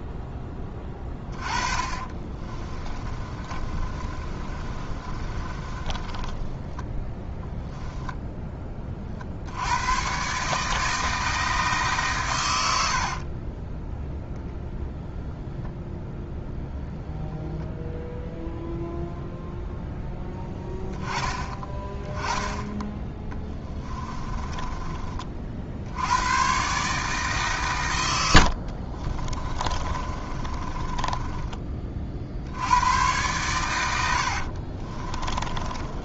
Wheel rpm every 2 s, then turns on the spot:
20, 20, 30, 10, 20, 160, 70, 0, 0, 0, 10, 20, 30, 140, 50, 20, 100, 40.
0-8 12-14 22-26 28-32 34-36